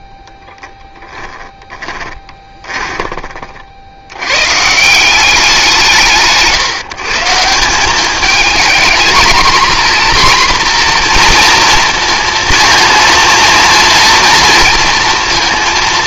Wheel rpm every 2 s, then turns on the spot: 0, 20, 140, 150, 220, 240, 230, 230.
2-4